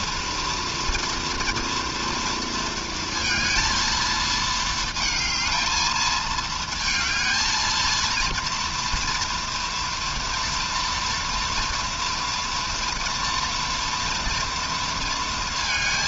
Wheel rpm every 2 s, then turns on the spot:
230, 230, 220, 220, 230, 230, 230, 230.
none